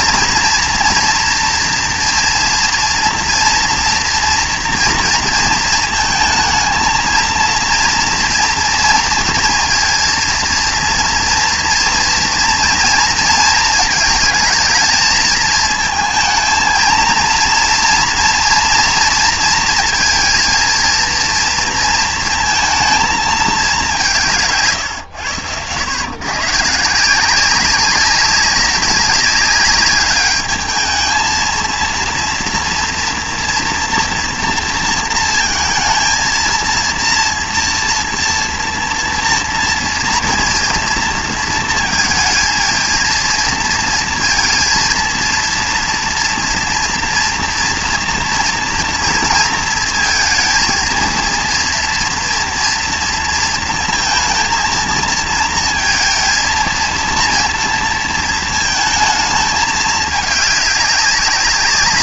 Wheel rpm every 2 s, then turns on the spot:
230, 230, 230, 220, 230, 230, 230, 220, 230, 230, 230, 230, 160, 150, 190, 210, 230, 230, 230, 230, 230, 230, 230, 230, 230, 230, 240, 230, 230, 230, 200.
none